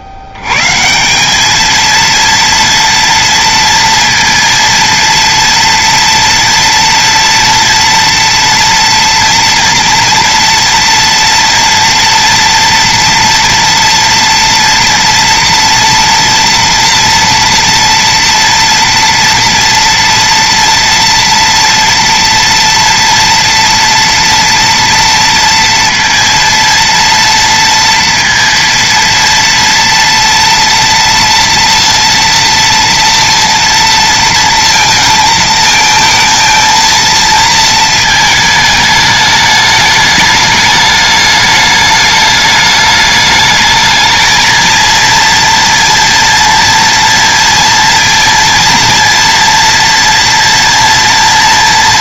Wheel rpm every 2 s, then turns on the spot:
80, 230, 230, 230, 230, 230, 230, 230, 230, 230, 230, 230, 230, 230, 230, 240, 230, 230, 220, 220, 210, 210, 220, 230, 230, 230.
none